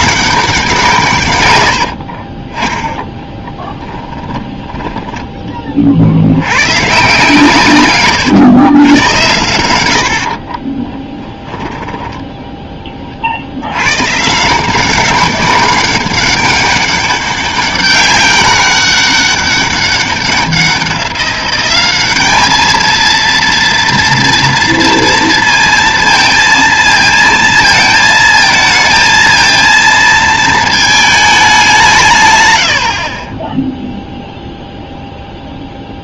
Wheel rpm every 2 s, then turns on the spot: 170, 10, 20, 120, 110, 20, 10, 180, 200, 200, 190, 220, 230, 230, 230, 220, 90, 0.
4-6 10-12